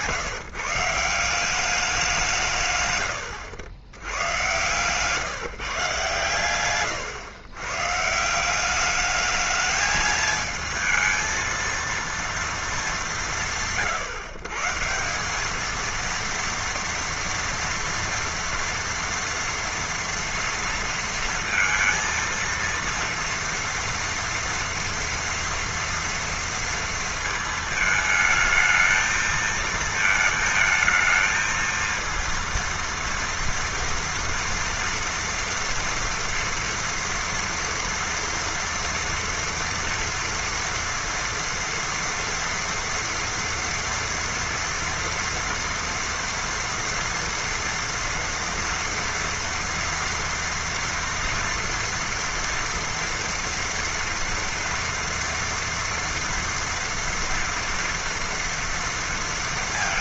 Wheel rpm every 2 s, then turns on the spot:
150, 180, 110, 130, 160, 220, 230, 130, 230, 230, 230, 230, 230, 230, 220, 220, 230, 230, 230, 230, 230, 230, 230, 230, 230, 230, 230, 230, 230, 240.
none